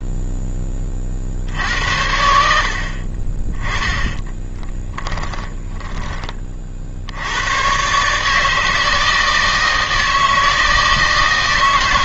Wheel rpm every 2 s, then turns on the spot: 10, 70, 20, 40, 160, 160.
4-6